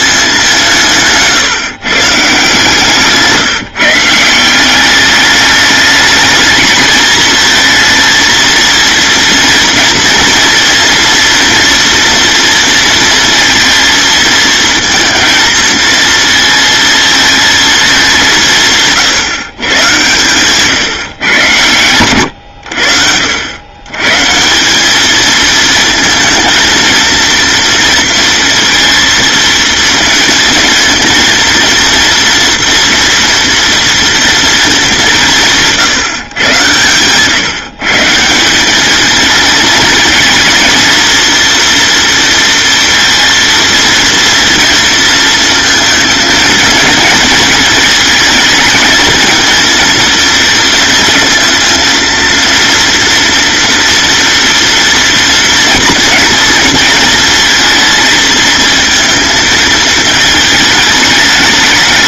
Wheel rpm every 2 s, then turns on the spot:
140, 160, 200, 220, 230, 230, 230, 230, 230, 140, 120, 70, 220, 230, 230, 230, 240, 180, 130, 220, 230, 230, 230, 230, 230, 230, 230, 240, 230, 230, 200.
none